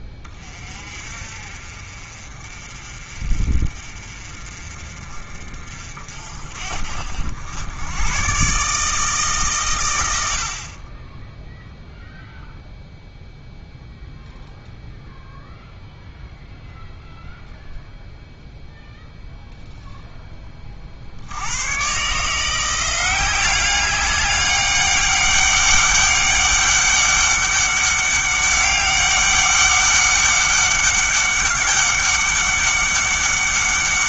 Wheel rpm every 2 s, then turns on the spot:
30, 40, 40, 60, 140, 50, 0, 0, 0, 0, 30, 170, 200, 200, 200, 200, 200.
none